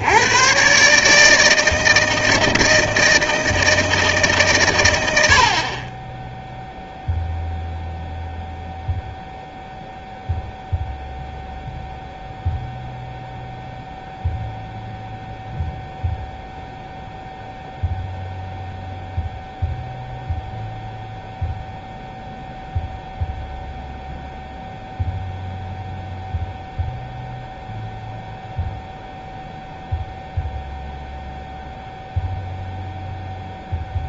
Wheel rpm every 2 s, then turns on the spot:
140, 160, 120, 0, 0, 0, 0, 0, 0, 0, 0, 0, 0, 0, 0, 0, 0.
none